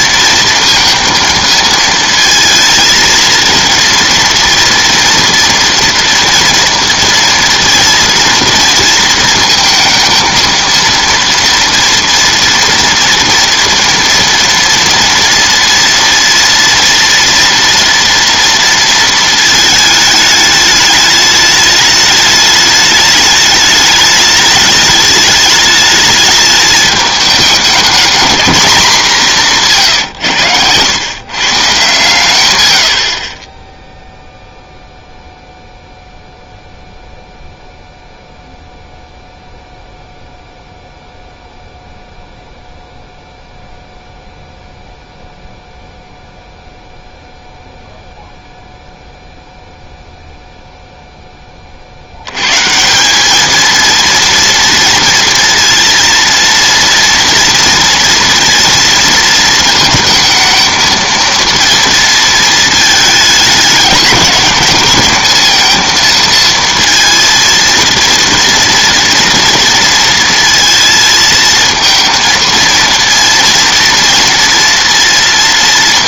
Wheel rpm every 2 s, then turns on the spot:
230, 230, 230, 230, 230, 230, 230, 230, 230, 230, 210, 210, 210, 210, 210, 110, 90, 0, 0, 0, 0, 0, 0, 0, 0, 0, 150, 230, 230, 230, 220, 220, 210, 230, 230, 230, 230, 230.
none